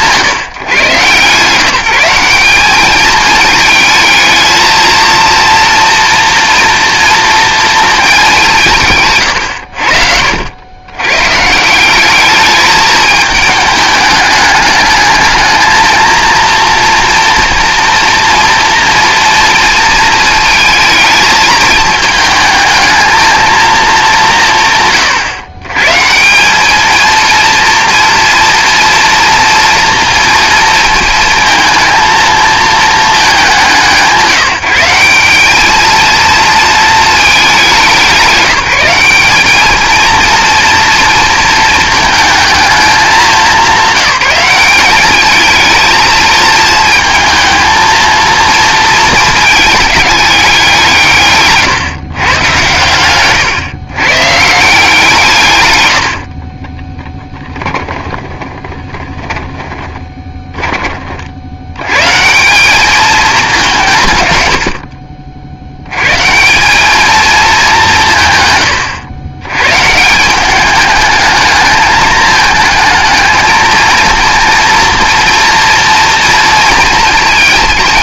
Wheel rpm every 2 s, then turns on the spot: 140, 210, 230, 230, 160, 100, 210, 210, 230, 230, 220, 220, 150, 210, 230, 230, 220, 170, 220, 190, 230, 220, 200, 230, 220, 180, 110, 160, 20, 30, 30, 190, 80, 200, 110, 210, 220, 230, 230.
56-60